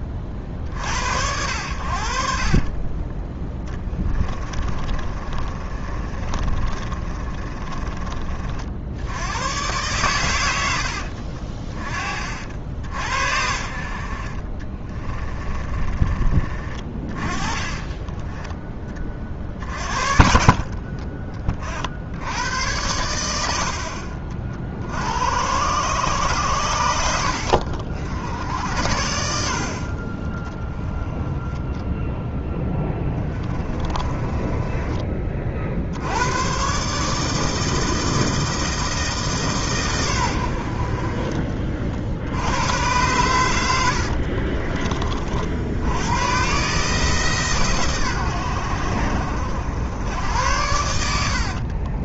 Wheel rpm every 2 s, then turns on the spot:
50, 30, 30, 30, 60, 80, 60, 30, 30, 20, 50, 100, 60, 90, 80, 10, 20, 20, 130, 160, 60, 100, 40, 140, 80, 80.
2-8 14-16 20-22 32-36